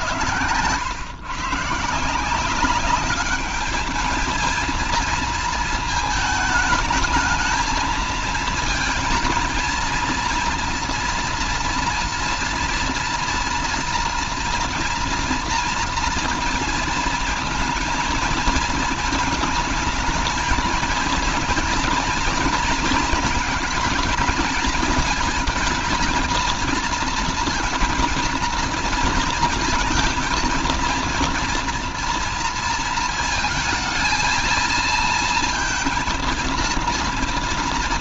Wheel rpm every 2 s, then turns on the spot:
110, 190, 230, 220, 230, 240, 230, 230, 230, 220, 220, 230, 220, 230, 230, 230, 230, 230, 230.
none